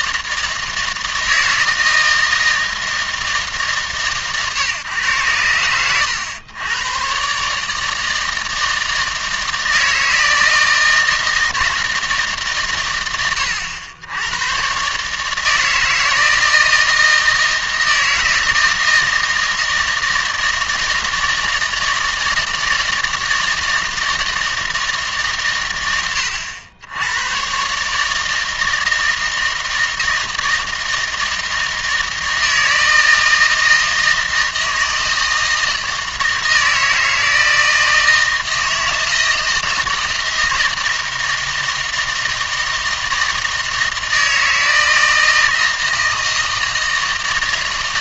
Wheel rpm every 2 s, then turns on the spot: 160, 160, 130, 110, 160, 160, 120, 130, 160, 160, 160, 160, 160, 90, 160, 160, 160, 160, 160, 160, 160, 160, 160, 160.
none